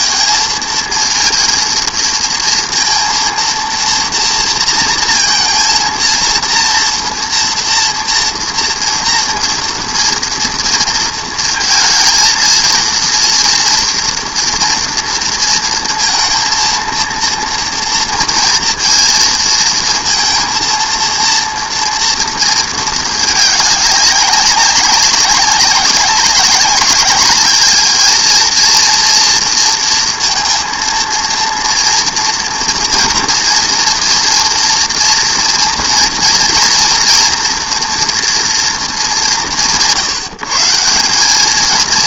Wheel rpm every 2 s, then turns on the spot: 220, 230, 230, 230, 240, 230, 230, 230, 230, 230, 230, 230, 200, 200, 230, 230, 230, 230, 230, 210, 140.
none